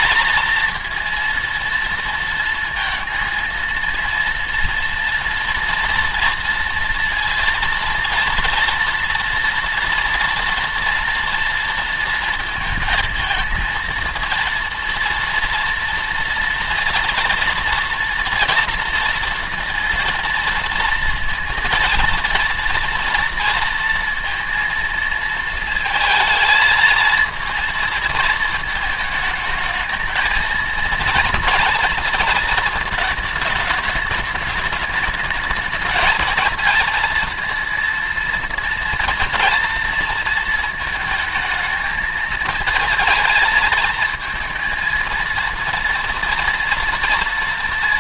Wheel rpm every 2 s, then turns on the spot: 230, 230, 230, 230, 230, 230, 230, 230, 230, 230, 230, 230, 230, 230, 220, 220, 220, 210, 220, 230, 230, 220, 230, 230.
none